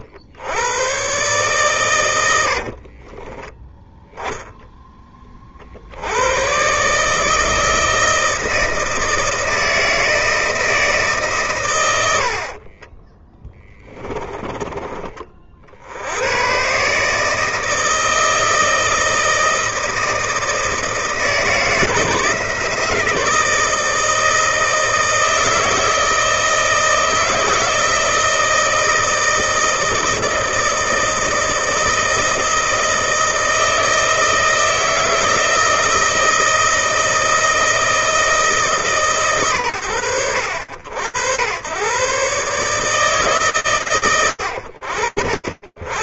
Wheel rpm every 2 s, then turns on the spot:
90, 110, 10, 70, 160, 160, 100, 20, 80, 160, 160, 160, 160, 160, 160, 160, 160, 160, 160, 170, 80, 130, 90.
14-16